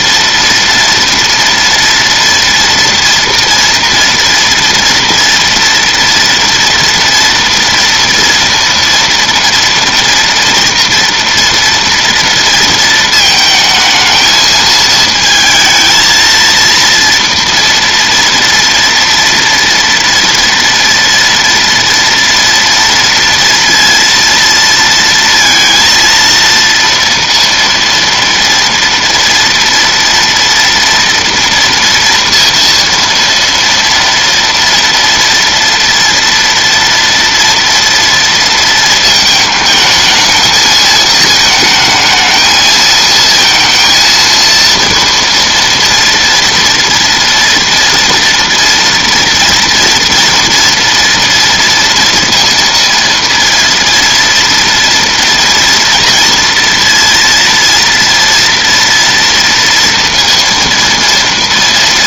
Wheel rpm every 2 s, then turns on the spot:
230, 230, 230, 230, 230, 230, 230, 220, 230, 230, 230, 230, 230, 230, 230, 230, 230, 240, 230, 230, 220, 220, 230, 230, 230, 230, 230, 230, 230, 230, 230.
none